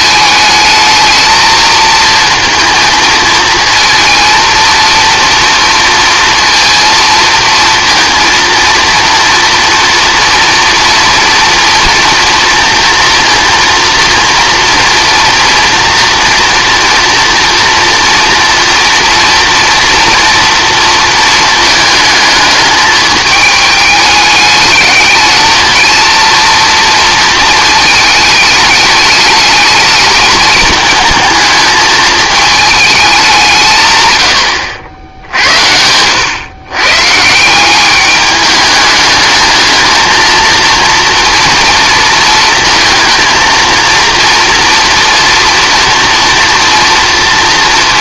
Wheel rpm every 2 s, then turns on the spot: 220, 230, 230, 230, 230, 240, 230, 230, 240, 240, 230, 210, 210, 230, 210, 220, 220, 90, 120, 210, 230, 220, 230, 230.
none